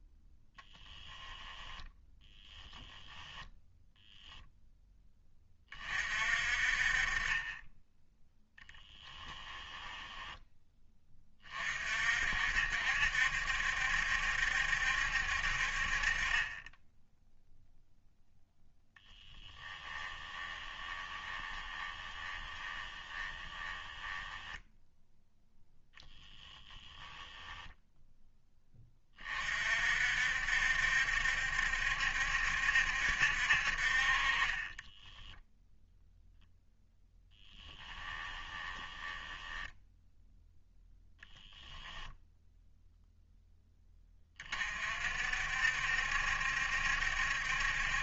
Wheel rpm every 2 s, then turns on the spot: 10, 10, 10, 30, 10, 10, 70, 70, 10, 10, 20, 20, 0, 10, 20, 70, 70, 20, 0, 10, 0, 0, 40, 70.
0-2 8-10 18-24 34-36 38-40